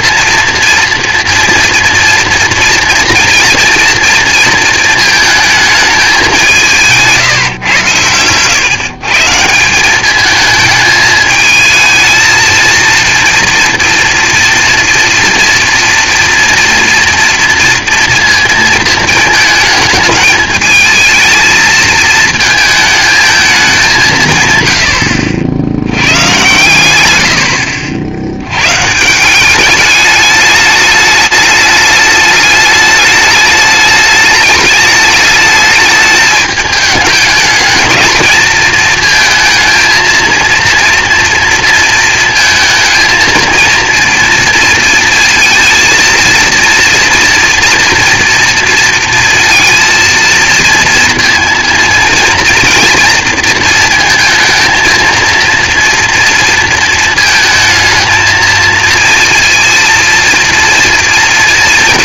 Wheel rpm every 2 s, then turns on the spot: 230, 230, 230, 170, 120, 220, 230, 240, 230, 230, 220, 220, 120, 120, 120, 210, 210, 210, 210, 230, 230, 230, 230, 230, 230, 230, 230, 220, 230, 230, 230.
none